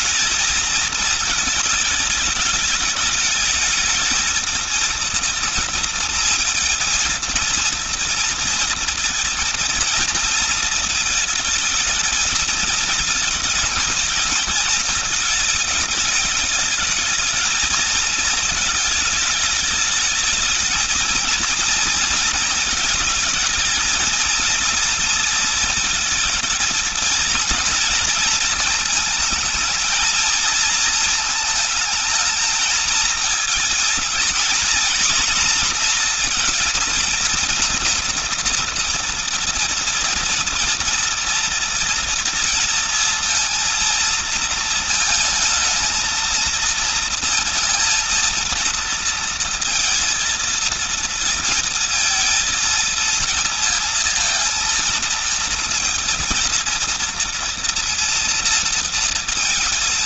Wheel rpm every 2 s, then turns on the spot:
220, 210, 230, 230, 230, 220, 220, 220, 210, 220, 220, 220, 230, 230, 220, 220, 220, 230, 230, 230, 230, 230, 230, 230, 230, 230, 230, 230, 230, 230.
none